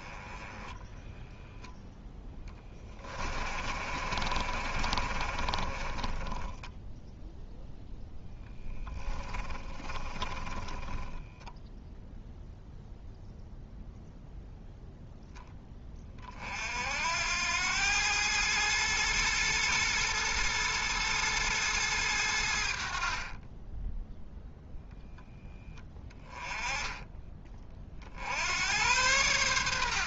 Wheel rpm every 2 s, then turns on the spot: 10, 20, 40, 10, 10, 30, 0, 0, 60, 110, 110, 60, 0, 10, 80.
2-8 10-12